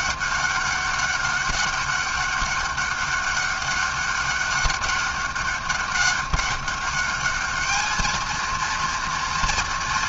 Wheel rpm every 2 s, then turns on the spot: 200, 200, 200, 210, 230.
none